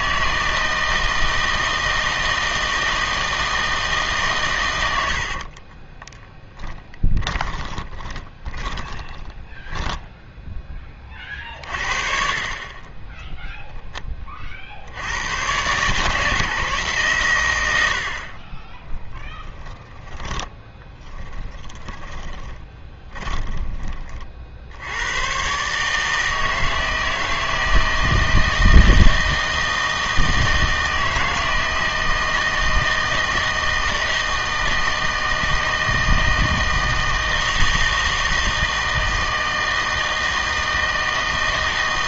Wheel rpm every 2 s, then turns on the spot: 160, 160, 100, 20, 20, 20, 20, 60, 150, 20, 20, 20, 80, 160, 160, 160, 160, 160, 160, 160, 160.
6-10 18-24